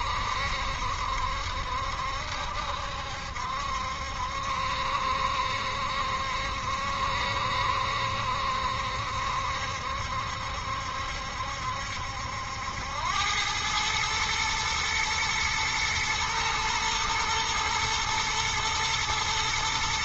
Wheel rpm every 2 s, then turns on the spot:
70, 70, 70, 70, 70, 70, 100, 120, 120, 110.
none